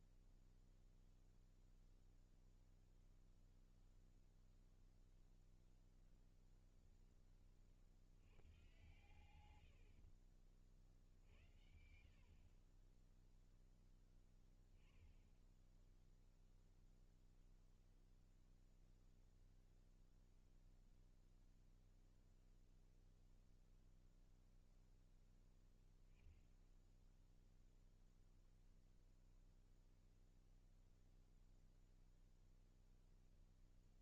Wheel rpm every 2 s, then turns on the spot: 0, 0, 0, 20, 120, 60, 10, 10, 0, 0, 0, 0, 0, 0, 0, 0, 0.
none